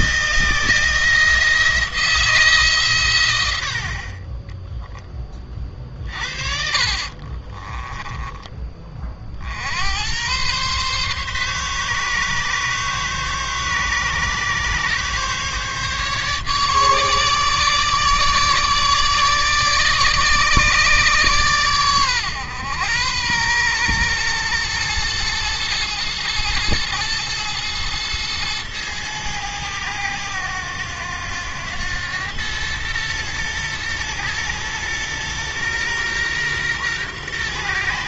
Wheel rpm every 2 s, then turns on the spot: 170, 130, 10, 30, 30, 130, 140, 140, 150, 150, 150, 110, 110, 110, 110, 100, 110, 120, 120.
6-8